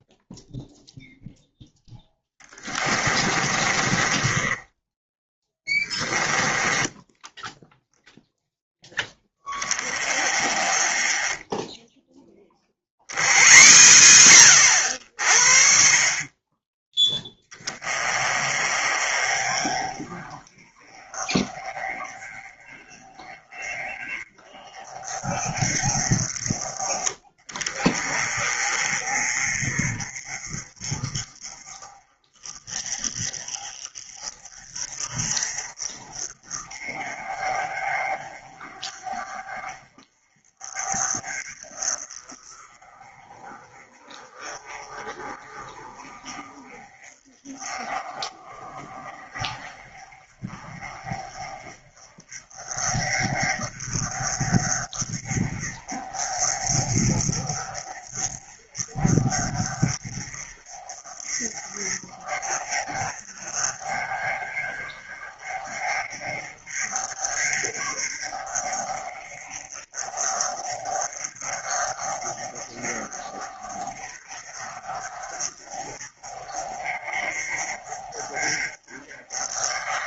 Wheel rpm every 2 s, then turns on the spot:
0, 20, 10, 10, 10, 20, 110, 80, 10, 30, 30, 30, 30, 20, 30, 30, 30, 30, 30, 30, 30, 30, 30, 30, 30, 30, 30, 30, 30, 30, 30, 30, 30, 30, 30, 30, 30, 30, 40, 30.
2-8